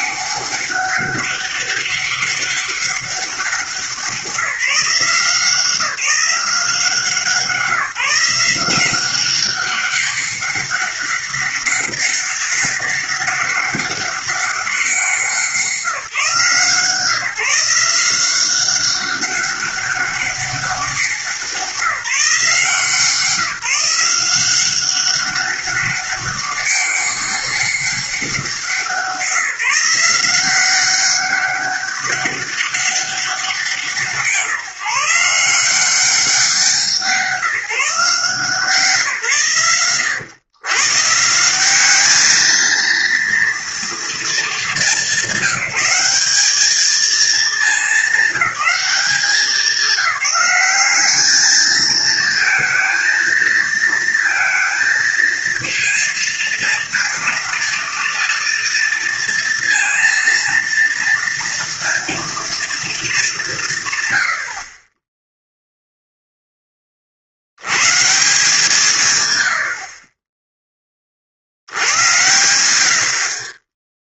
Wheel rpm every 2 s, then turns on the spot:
200, 200, 180, 180, 170, 200, 200, 190, 150, 180, 200, 170, 180, 200, 180, 180, 200, 160, 180, 160, 120, 220, 220, 210, 210, 190, 230, 230, 230, 230, 230, 230, 70, 10, 150, 10, 80.
none